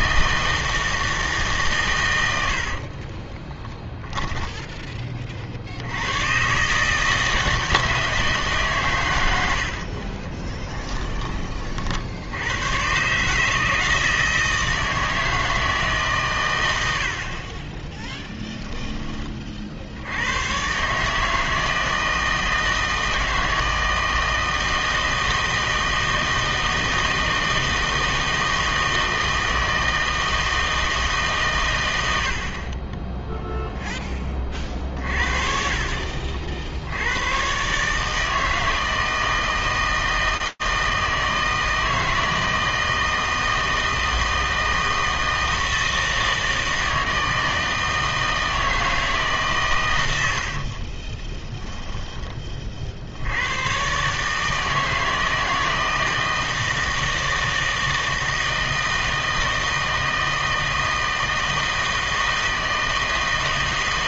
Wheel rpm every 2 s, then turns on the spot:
160, 60, 10, 130, 140, 20, 100, 160, 100, 20, 120, 160, 160, 160, 160, 160, 40, 40, 60, 160, 160, 160, 160, 160, 160, 60, 20, 150, 160, 160, 160, 160.
2-4 10-12 18-20 50-52